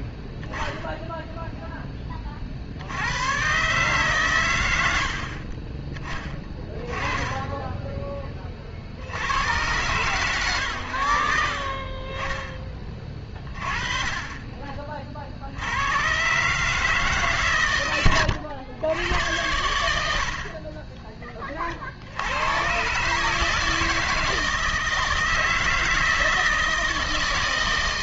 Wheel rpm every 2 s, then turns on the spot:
10, 60, 90, 20, 40, 100, 20, 30, 140, 100, 40, 110, 160, 160.
none